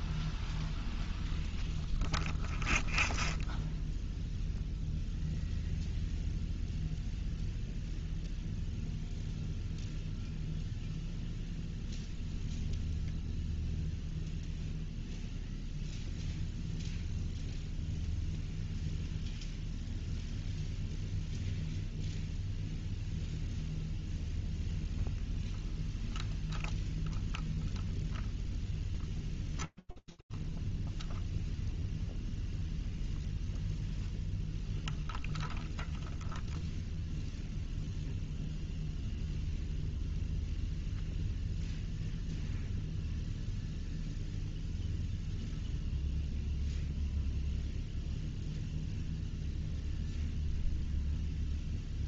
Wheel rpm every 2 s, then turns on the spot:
0, 0, 0, 0, 0, 0, 0, 0, 0, 0, 0, 0, 0, 0, 0, 0, 0, 0, 0, 0, 0, 0, 0, 0, 0, 0.
none